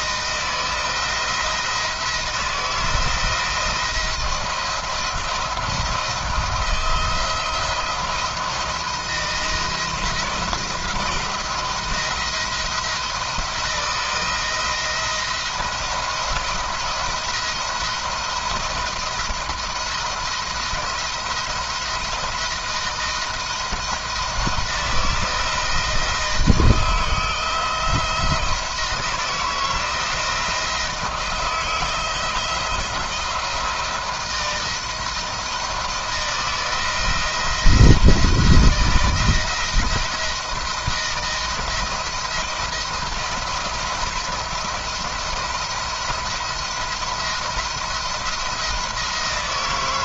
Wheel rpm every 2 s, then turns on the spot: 160, 160, 170, 160, 170, 170, 170, 170, 170, 170, 170, 170, 160, 170, 160, 160, 170, 170, 170, 170, 170, 170, 170, 170, 170.
none